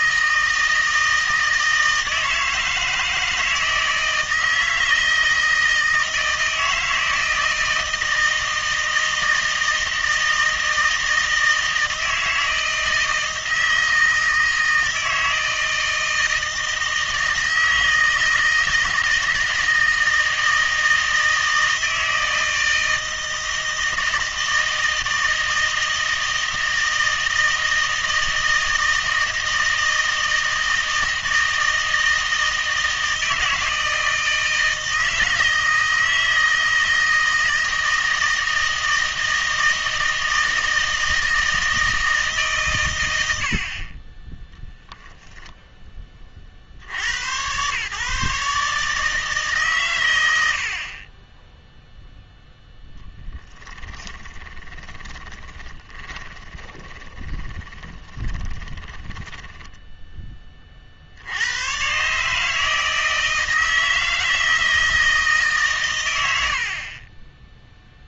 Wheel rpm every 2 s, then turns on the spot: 160, 160, 160, 160, 160, 160, 160, 160, 160, 160, 160, 160, 160, 160, 160, 160, 160, 160, 160, 160, 160, 130, 0, 40, 150, 50, 0, 20, 20, 20, 40, 160, 160, 50.
54-60